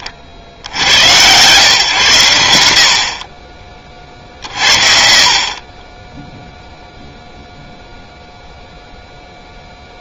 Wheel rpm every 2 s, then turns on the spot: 30, 100, 60, 0, 0.
4-6